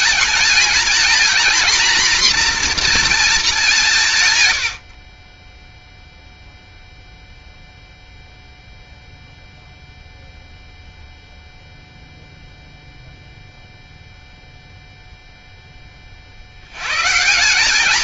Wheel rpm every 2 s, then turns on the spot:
230, 240, 100, 0, 0, 0, 0, 0, 70.
none